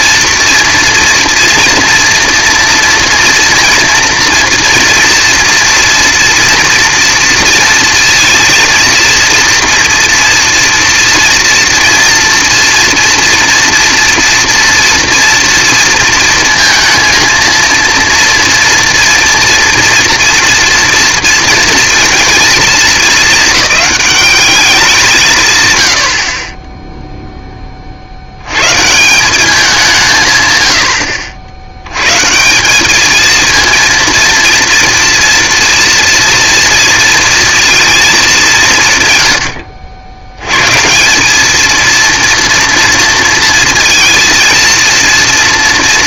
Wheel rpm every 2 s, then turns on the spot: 230, 230, 230, 230, 230, 230, 230, 230, 230, 240, 230, 230, 200, 30, 80, 130, 170, 230, 230, 190, 100, 230, 230.
none